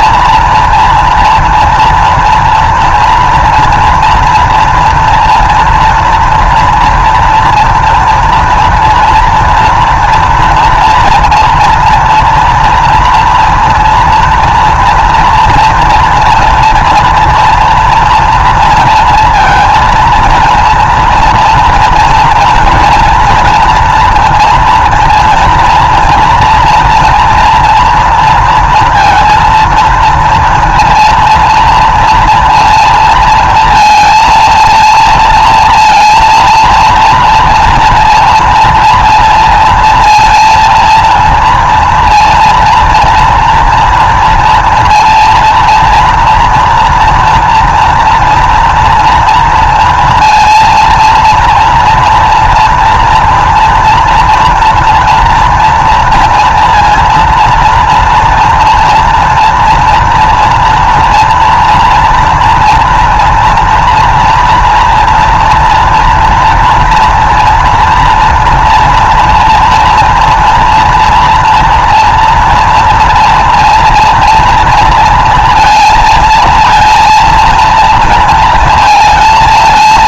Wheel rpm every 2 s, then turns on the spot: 230, 230, 240, 230, 230, 230, 230, 230, 230, 230, 230, 230, 230, 240, 230, 230, 230, 230, 230, 230, 230, 230, 230, 230, 230, 230, 240, 230, 240, 230, 230, 230, 230, 230, 240, 230, 230, 230, 230, 230.
none